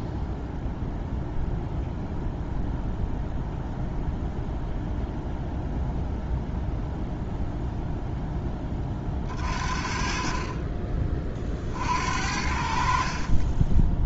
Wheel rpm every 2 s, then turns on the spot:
0, 0, 0, 0, 20, 30, 50.
none